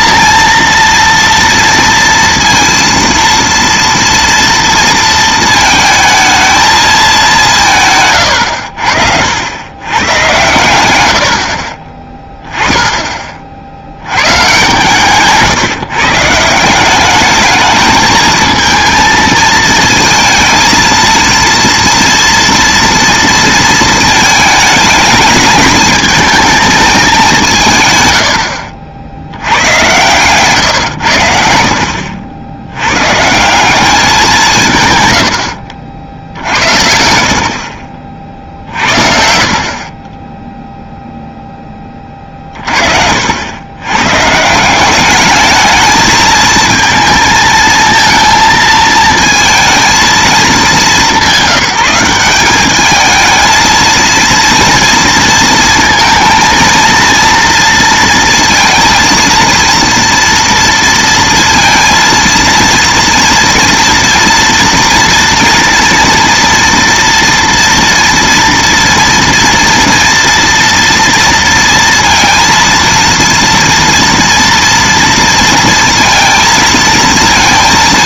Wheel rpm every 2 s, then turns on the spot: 230, 230, 230, 220, 80, 90, 10, 150, 180, 220, 230, 230, 210, 220, 50, 120, 90, 160, 70, 60, 0, 40, 180, 220, 220, 210, 200, 230, 230, 230, 230, 230, 230, 240, 230, 230, 230, 230, 230.
none